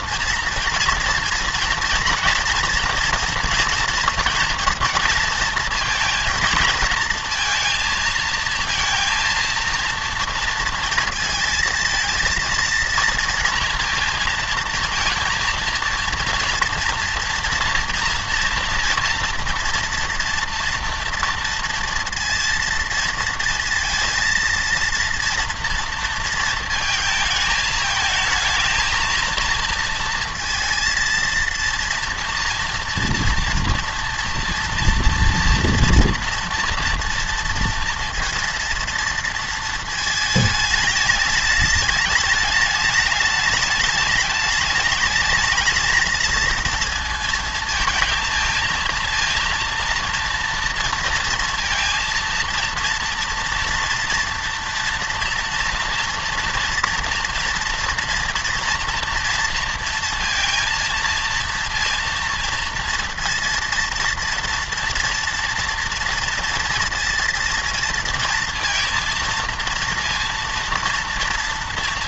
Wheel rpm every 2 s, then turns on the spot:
230, 230, 230, 230, 230, 230, 230, 230, 230, 240, 230, 230, 230, 220, 230, 230, 240, 230, 230, 230, 210, 210, 220, 230, 230, 230, 230, 230, 230, 240, 230, 230, 230, 230, 230, 230.
none